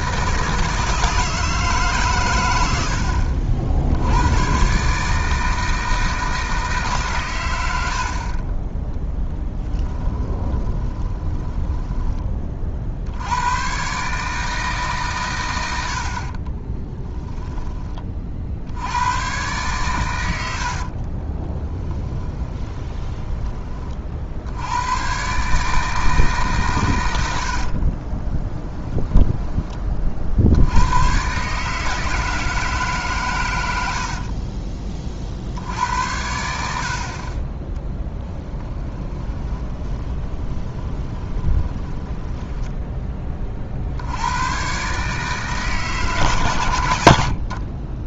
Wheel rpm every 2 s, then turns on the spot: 160, 90, 140, 150, 10, 10, 60, 150, 20, 80, 60, 20, 110, 120, 10, 90, 150, 30, 60, 20, 20, 10, 130, 100.
10-12 16-18 20-24 28-30 38-42 46-48